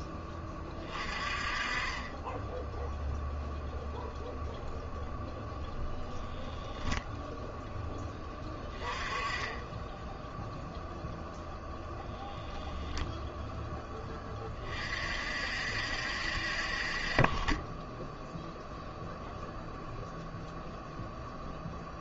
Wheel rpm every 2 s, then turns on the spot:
30, 0, 0, 0, 20, 0, 0, 40, 40, 0, 0.
none